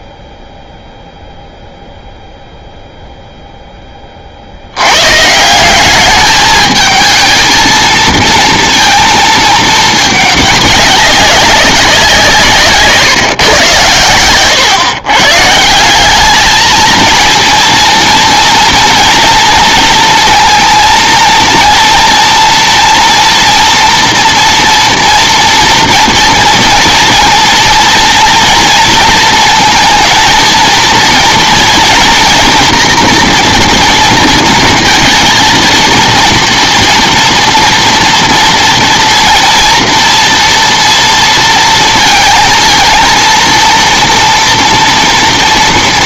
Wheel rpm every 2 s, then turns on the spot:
0, 0, 90, 220, 230, 200, 150, 120, 220, 230, 230, 230, 240, 230, 230, 230, 230, 230, 230, 230, 230, 230, 230.
none